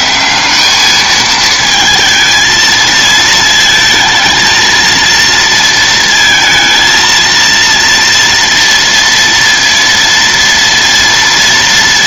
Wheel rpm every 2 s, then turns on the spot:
200, 220, 230, 230, 230, 230.
none